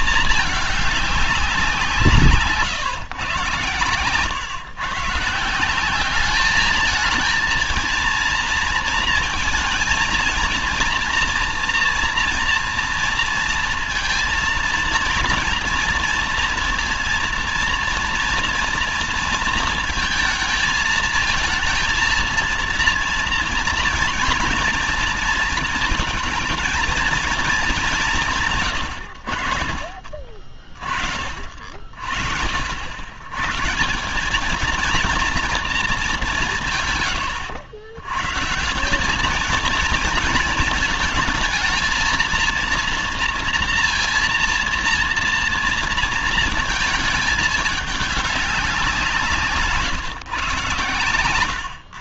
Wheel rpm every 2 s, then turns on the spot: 210, 130, 140, 220, 230, 230, 230, 230, 230, 230, 220, 230, 230, 230, 110, 40, 90, 230, 130, 180, 220, 230, 230, 220, 180, 130.
50-52